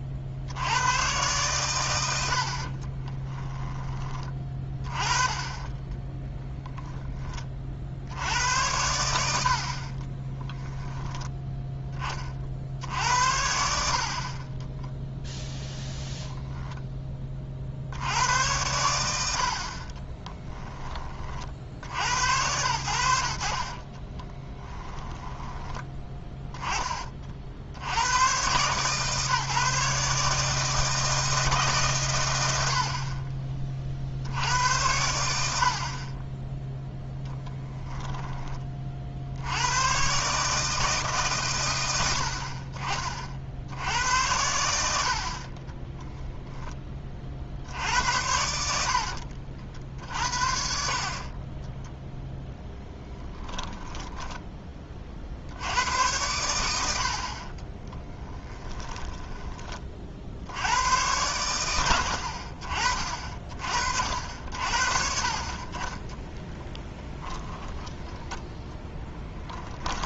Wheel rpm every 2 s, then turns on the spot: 90, 40, 20, 0, 90, 10, 60, 20, 10, 90, 20, 90, 20, 20, 130, 160, 70, 80, 0, 30, 150, 40, 70, 10, 70, 60, 10, 20, 90, 10, 80, 40, 60, 10, 10.
2-4 10-12 24-26 48-50 58-60 66-70